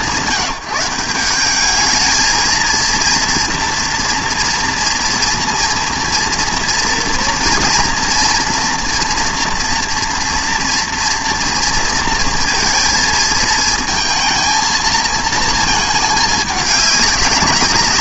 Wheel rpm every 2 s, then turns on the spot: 180, 230, 230, 230, 240, 230, 230, 230, 210.
none